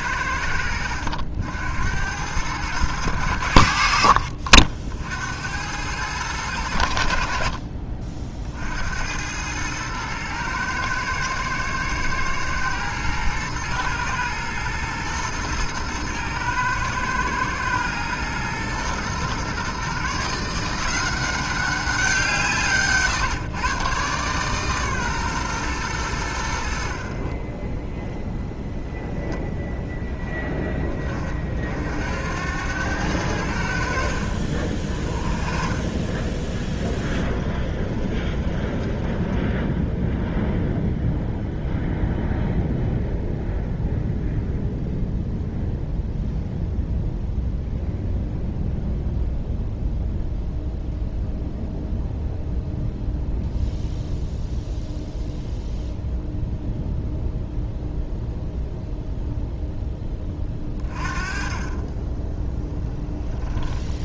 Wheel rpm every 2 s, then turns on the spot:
90, 100, 60, 90, 70, 110, 110, 110, 110, 120, 160, 150, 130, 70, 0, 20, 90, 50, 10, 10, 0, 0, 0, 0, 0, 0, 0, 0, 0, 0, 30, 10.
36-40